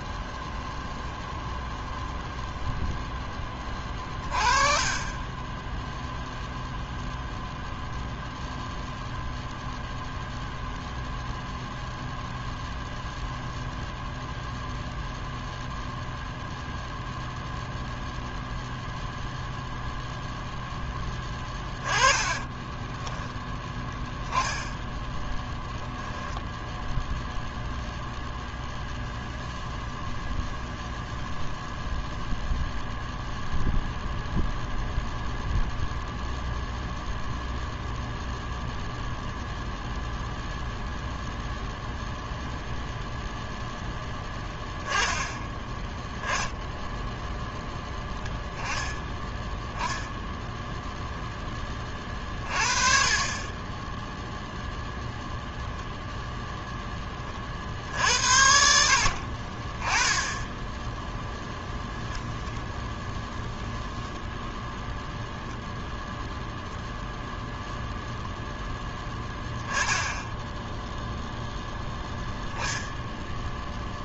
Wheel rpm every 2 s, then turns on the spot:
0, 0, 30, 0, 0, 0, 0, 0, 0, 0, 10, 10, 20, 0, 0, 0, 0, 0, 0, 0, 0, 0, 10, 0, 0, 0, 40, 0, 10, 60, 10, 10, 0, 0, 10, 0, 0.
22-26